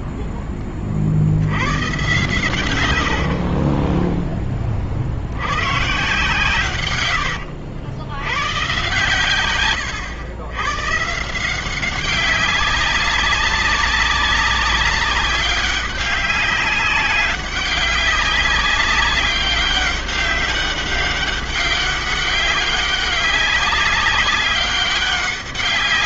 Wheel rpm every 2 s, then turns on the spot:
10, 120, 20, 120, 110, 110, 190, 200, 200, 200, 200, 200, 200.
none